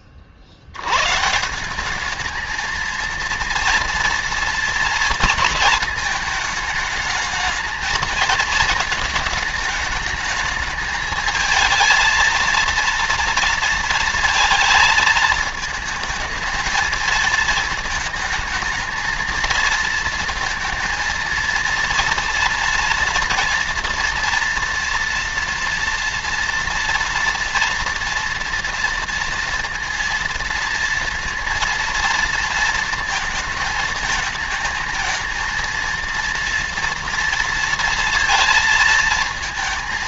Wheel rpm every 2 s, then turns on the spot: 90, 230, 230, 220, 220, 220, 230, 220, 220, 220, 230, 230, 230, 230, 230, 230, 230, 220, 230, 220.
none